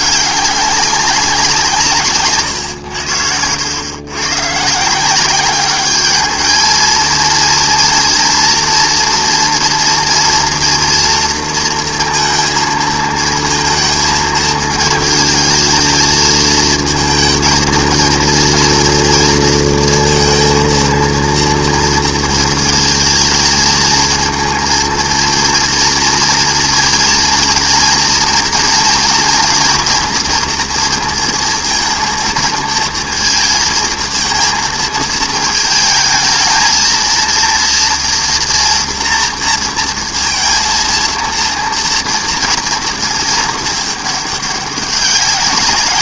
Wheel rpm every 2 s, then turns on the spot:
210, 150, 110, 210, 230, 240, 230, 220, 220, 230, 230, 230, 220, 230, 230, 240, 220, 230, 220, 230, 230, 230, 210.
2-4